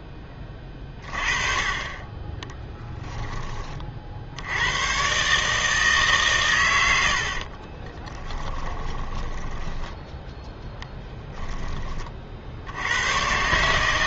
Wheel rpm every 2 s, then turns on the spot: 20, 20, 100, 100, 10, 10, 80.
2-4 8-12